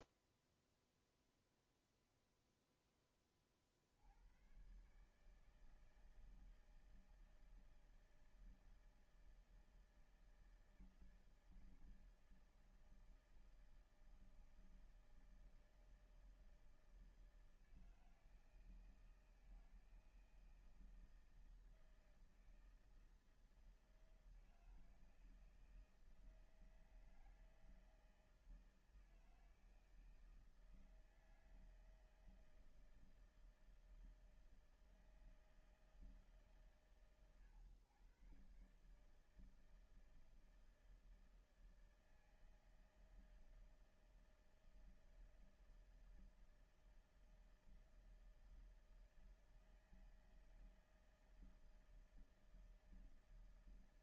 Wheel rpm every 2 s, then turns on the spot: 0, 10, 120, 160, 160, 160, 160, 160, 160, 160, 160, 160, 160, 160, 160, 160, 160, 160, 140, 140, 160, 160, 160, 160, 160, 160, 160.
none